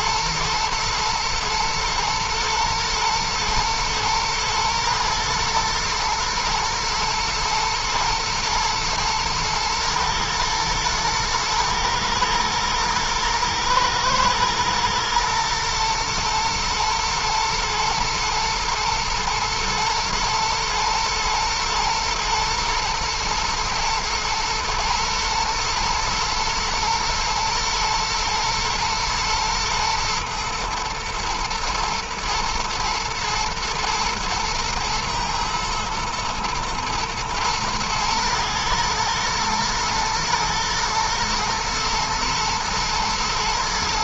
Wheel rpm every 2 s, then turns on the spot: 120, 120, 110, 120, 110, 110, 110, 120, 110, 110, 110, 120, 120, 120, 120, 110, 120, 110, 120, 110, 110, 110.
none